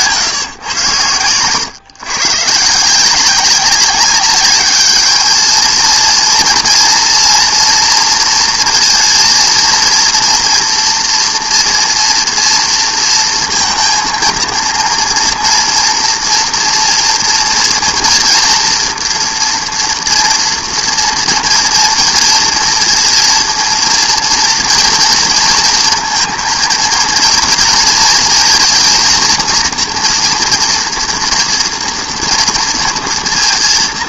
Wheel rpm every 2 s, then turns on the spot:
130, 130, 200, 230, 230, 230, 230, 230, 240, 230, 230, 230, 230, 230, 220, 230, 230.
none